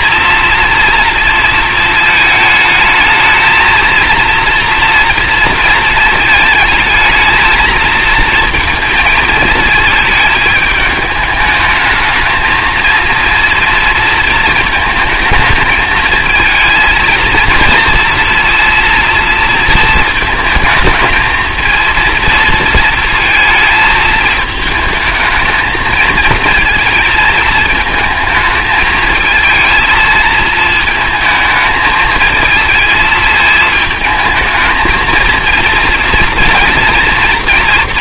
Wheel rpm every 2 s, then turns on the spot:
230, 220, 230, 220, 220, 220, 230, 220, 230, 230, 230, 230, 220, 220, 220, 220, 220, 230, 230.
none